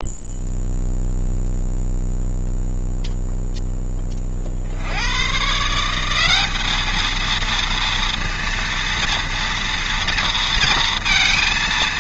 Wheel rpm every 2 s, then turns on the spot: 0, 0, 80, 220, 230, 230.
none